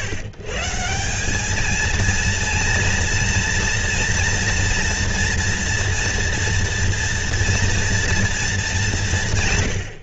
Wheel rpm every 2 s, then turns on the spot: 150, 230, 230, 230, 220.
none